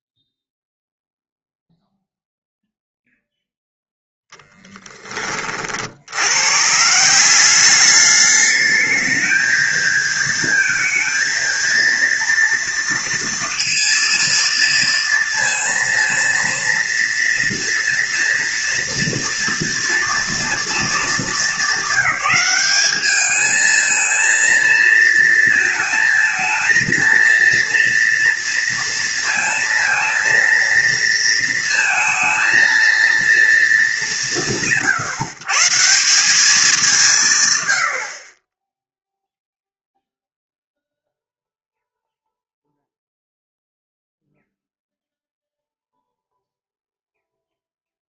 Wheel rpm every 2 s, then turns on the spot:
0, 0, 10, 140, 210, 230, 230, 230, 230, 230, 230, 210, 220, 230, 230, 230, 230, 130, 180, 20, 0, 0, 0, 0.
none